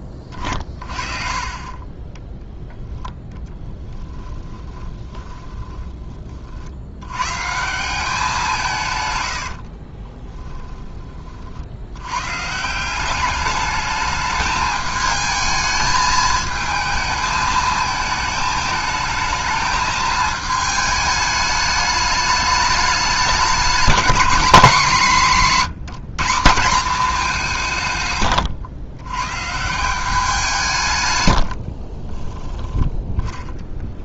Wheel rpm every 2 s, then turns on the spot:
20, 0, 20, 60, 170, 20, 170, 210, 220, 220, 220, 210, 200, 190, 120, 160, 10.
4-6 32-34